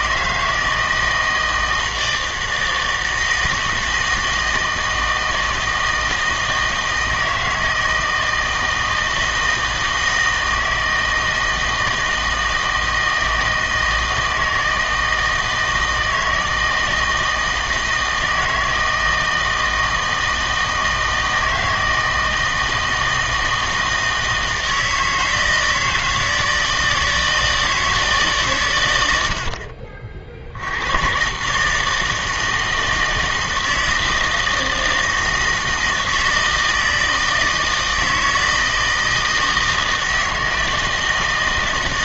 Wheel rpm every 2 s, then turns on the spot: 160, 160, 160, 160, 160, 160, 160, 160, 160, 160, 160, 160, 160, 160, 130, 80, 160, 160, 160, 160, 160.
none